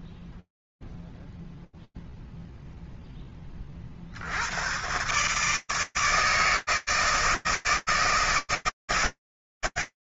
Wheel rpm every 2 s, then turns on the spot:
0, 0, 110, 160, 150.
none